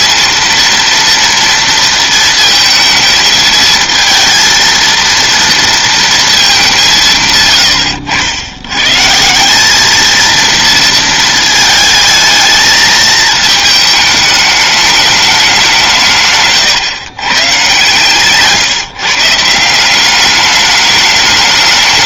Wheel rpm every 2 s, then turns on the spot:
230, 220, 230, 190, 100, 230, 220, 210, 140, 140, 200.
none